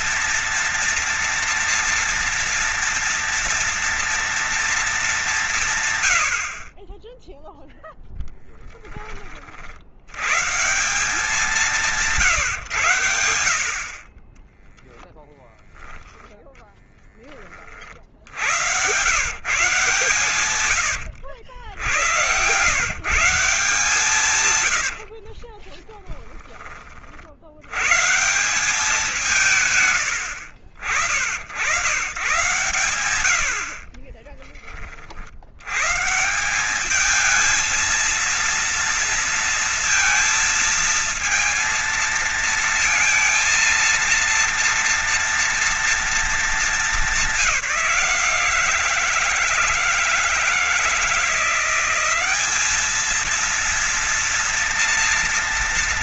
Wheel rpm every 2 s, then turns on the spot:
230, 230, 200, 20, 30, 180, 100, 0, 10, 100, 90, 130, 80, 40, 180, 80, 110, 40, 200, 230, 230, 230, 240, 200, 160, 170, 220, 230.
24-26